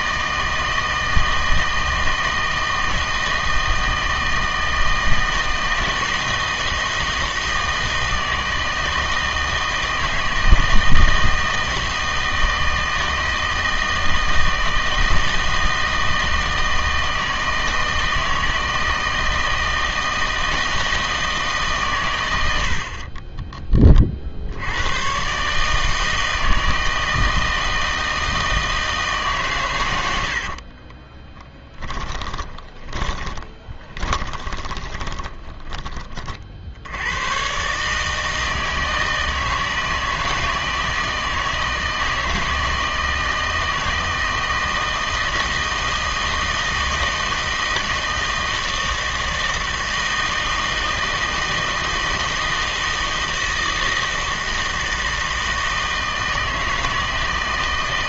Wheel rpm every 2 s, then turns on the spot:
160, 160, 160, 160, 160, 160, 160, 160, 160, 160, 160, 70, 90, 160, 160, 40, 20, 20, 70, 160, 160, 160, 160, 160, 160, 160, 160, 160, 160.
30-36